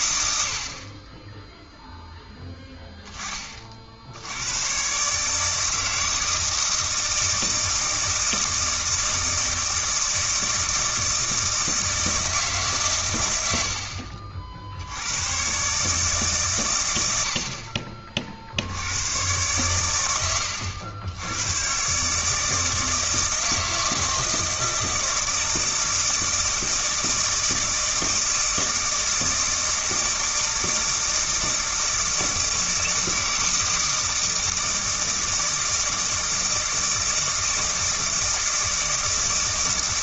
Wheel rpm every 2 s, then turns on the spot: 50, 10, 120, 160, 160, 160, 140, 70, 120, 80, 100, 160, 160, 160, 160, 160, 160, 160, 160, 160.
none